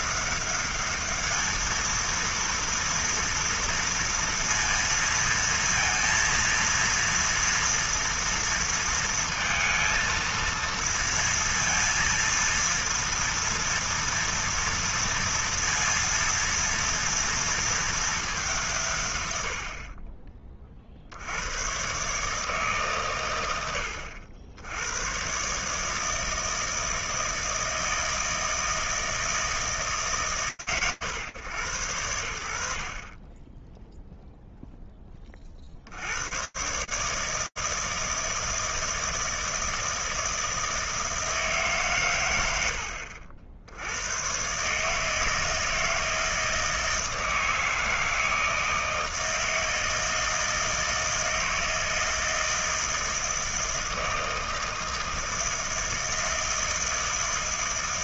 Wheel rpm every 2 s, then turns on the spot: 210, 230, 230, 230, 230, 230, 230, 230, 230, 150, 60, 140, 100, 160, 160, 140, 70, 0, 120, 160, 160, 90, 140, 160, 160, 160, 160, 160, 160.
none